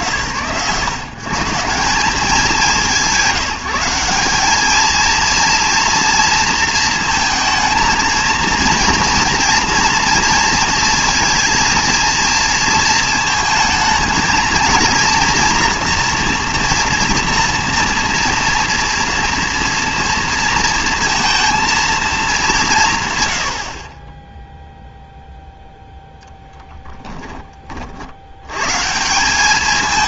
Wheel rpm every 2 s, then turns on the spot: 110, 190, 200, 230, 230, 230, 230, 230, 240, 230, 230, 190, 0, 10, 110.
26-28